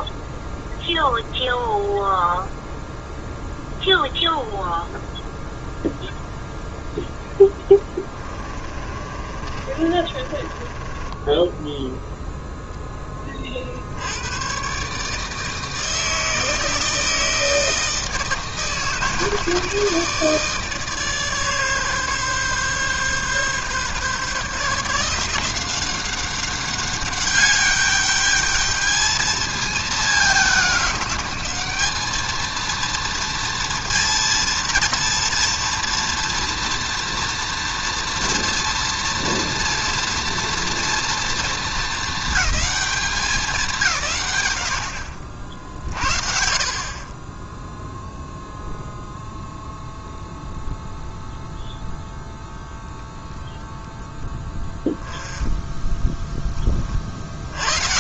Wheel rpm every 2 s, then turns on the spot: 0, 0, 0, 0, 20, 20, 0, 120, 160, 160, 150, 140, 150, 190, 210, 200, 230, 230, 230, 230, 230, 210, 90, 60, 0, 0, 0, 10, 20.
8-12